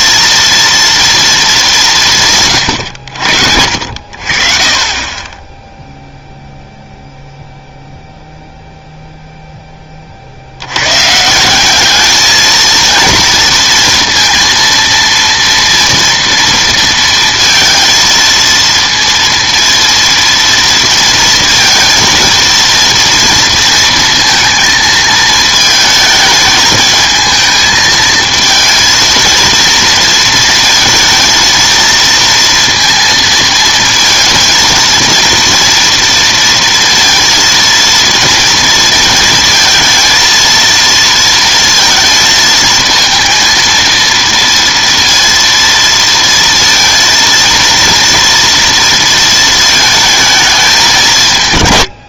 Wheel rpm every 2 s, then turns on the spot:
230, 130, 40, 0, 0, 80, 220, 230, 230, 230, 230, 230, 230, 220, 230, 230, 230, 230, 230, 230, 230, 220, 230, 230, 230, 210.
none